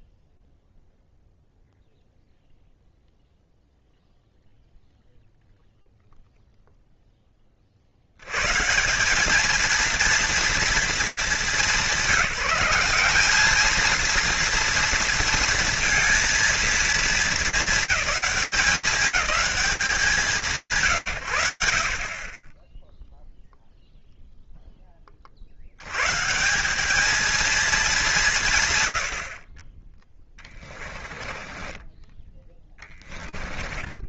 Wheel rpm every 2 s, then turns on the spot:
0, 0, 0, 0, 120, 230, 180, 230, 230, 200, 190, 30, 10, 180, 70, 20, 20.
30-34